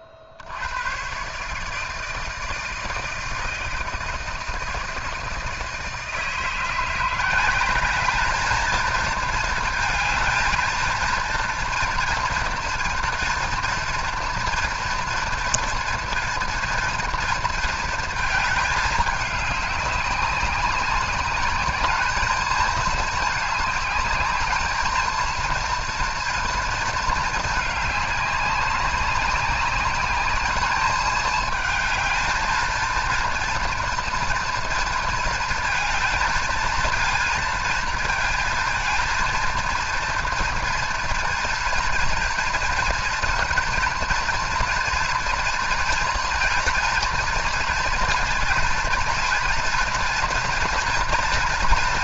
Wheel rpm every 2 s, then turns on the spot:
80, 160, 160, 160, 220, 230, 230, 230, 230, 210, 200, 220, 210, 230, 200, 210, 230, 230, 220, 230, 230, 230, 230, 230, 230, 230.
none